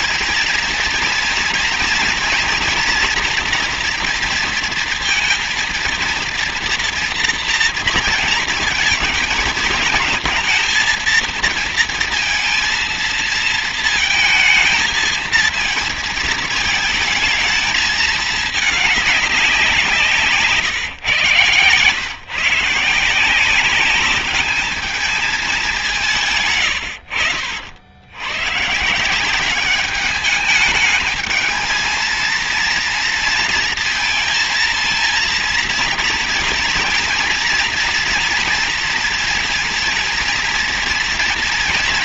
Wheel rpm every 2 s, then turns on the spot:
230, 230, 230, 230, 220, 230, 230, 220, 220, 210, 130, 160, 210, 80, 170, 220, 230, 230, 230, 230, 230.
none